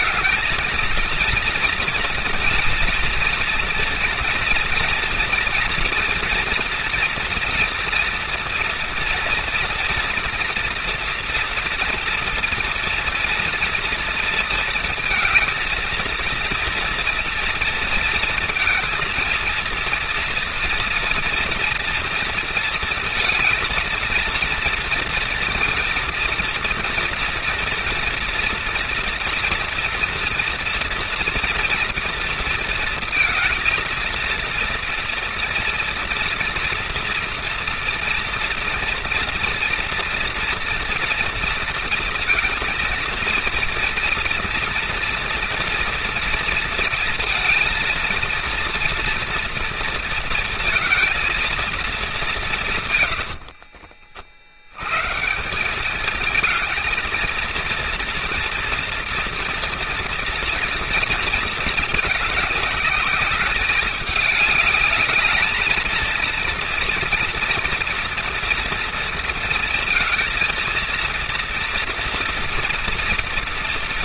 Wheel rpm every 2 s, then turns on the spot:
230, 230, 240, 230, 230, 230, 230, 230, 230, 230, 230, 230, 230, 230, 230, 230, 230, 230, 240, 230, 230, 230, 230, 230, 230, 230, 170, 90, 220, 230, 230, 210, 210, 230, 230, 230, 230.
none